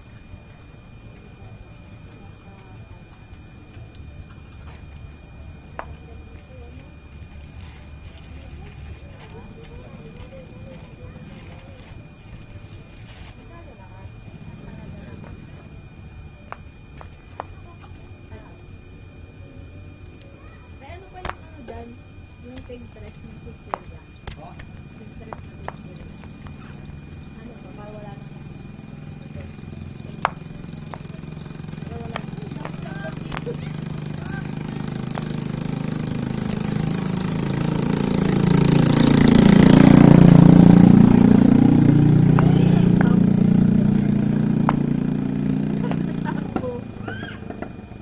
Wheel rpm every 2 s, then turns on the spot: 0, 0, 0, 0, 0, 0, 0, 0, 0, 0, 0, 0, 0, 0, 0, 0, 0, 0, 0, 0, 0, 0, 0, 0.
none